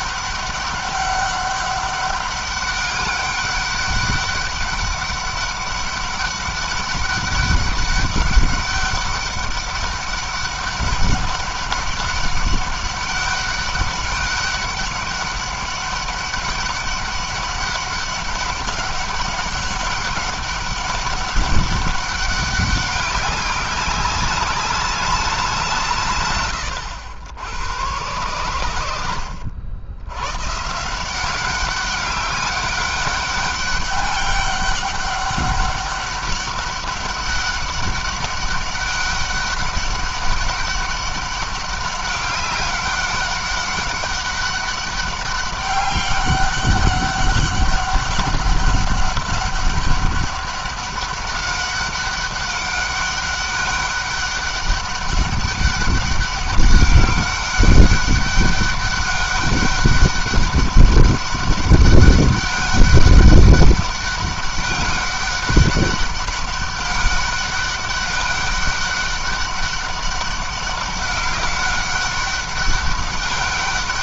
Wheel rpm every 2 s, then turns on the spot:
200, 200, 200, 200, 200, 200, 200, 200, 200, 200, 200, 200, 200, 100, 90, 150, 200, 200, 200, 200, 190, 200, 200, 200, 200, 200, 200, 200, 200, 200, 200, 200, 200, 200, 200, 200, 200.
none